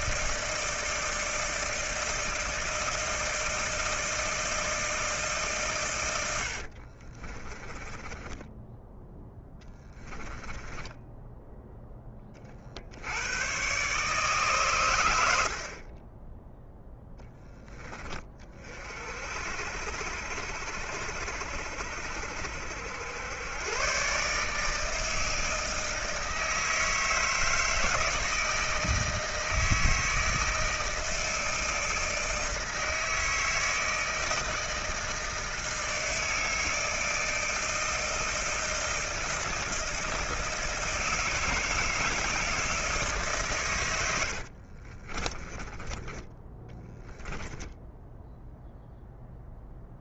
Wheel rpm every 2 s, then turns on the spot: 160, 160, 160, 60, 10, 10, 50, 140, 0, 40, 60, 60, 150, 160, 160, 160, 160, 160, 160, 160, 160, 160, 40, 10, 0.
6-12 44-48